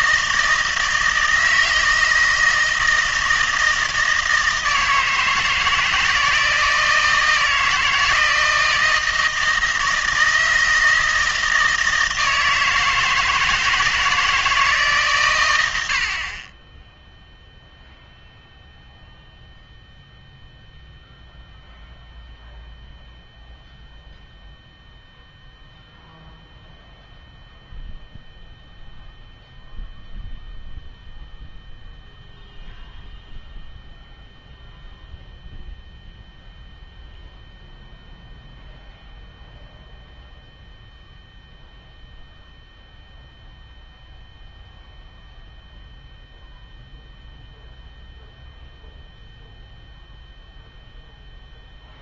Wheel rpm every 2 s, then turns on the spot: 160, 160, 160, 160, 160, 160, 160, 150, 10, 0, 0, 0, 0, 0, 0, 0, 0, 0, 0, 0, 0, 0, 0, 0, 0, 0.
none